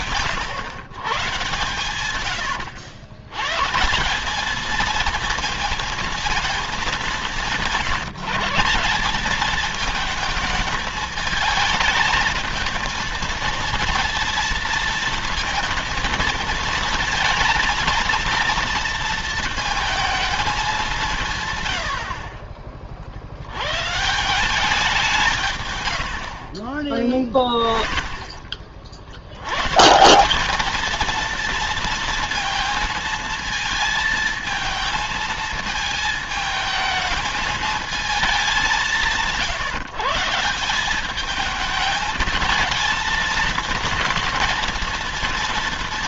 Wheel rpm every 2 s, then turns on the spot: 140, 120, 220, 220, 190, 220, 220, 230, 220, 230, 200, 50, 180, 40, 50, 210, 230, 220, 220, 190, 180, 220, 230.
26-28